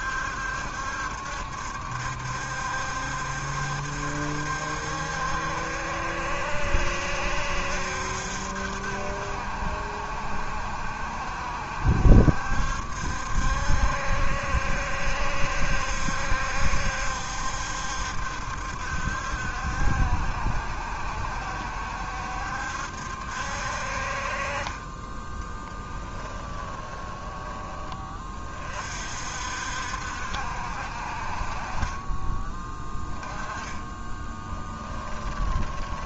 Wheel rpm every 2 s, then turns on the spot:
70, 70, 70, 70, 70, 70, 70, 70, 70, 70, 70, 70, 30, 10, 40, 60, 20, 10.
24-28 32-36